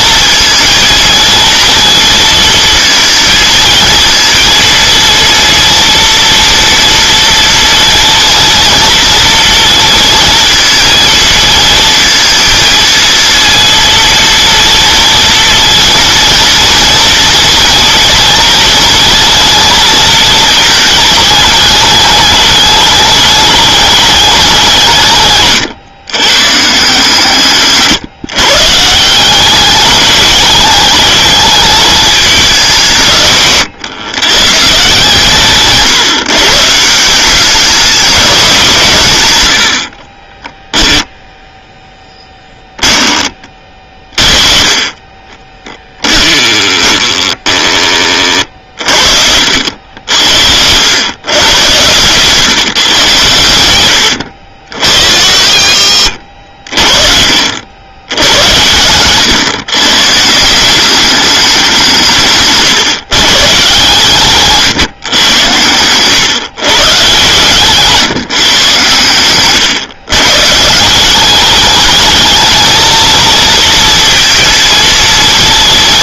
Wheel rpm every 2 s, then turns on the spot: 230, 230, 230, 230, 230, 230, 230, 230, 230, 220, 220, 210, 170, 150, 150, 210, 180, 140, 160, 170, 10, 10, 30, 10, 40, 100, 140, 80, 50, 100, 180, 140, 130, 130, 130, 170, 230, 230.
40-42